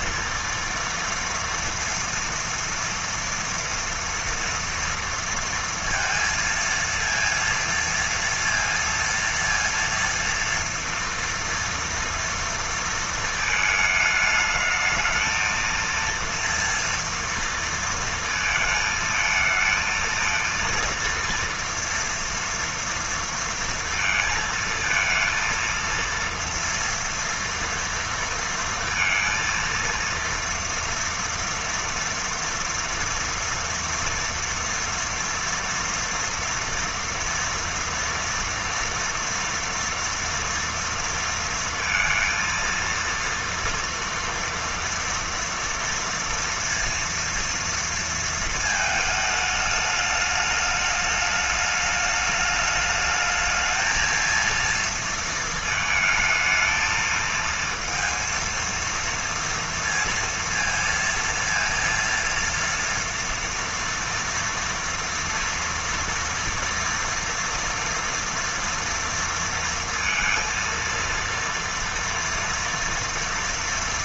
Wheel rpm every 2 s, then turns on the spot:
230, 230, 230, 230, 230, 230, 230, 220, 230, 230, 230, 230, 220, 230, 230, 230, 230, 230, 230, 230, 230, 230, 230, 230, 230, 210, 210, 230, 220, 230, 230, 230, 230, 230, 240, 230, 230.
none